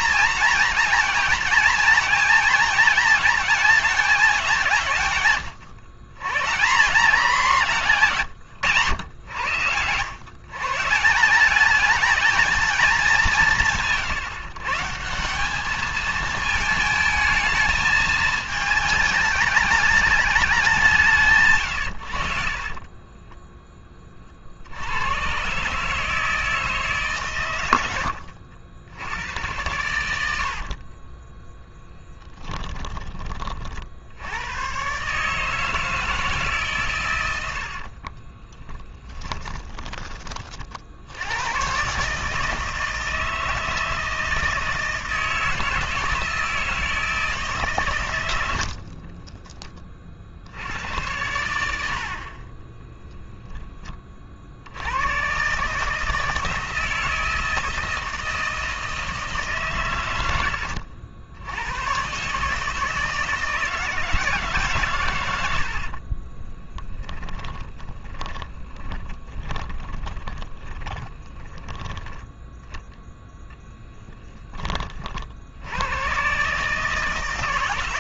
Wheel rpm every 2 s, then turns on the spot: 230, 220, 170, 160, 130, 140, 220, 130, 220, 210, 200, 40, 70, 160, 80, 60, 10, 110, 140, 20, 50, 160, 160, 160, 50, 90, 20, 70, 160, 160, 80, 150, 140, 10, 20, 20, 10, 20, 140.
22-24 30-34 38-40 52-54 66-72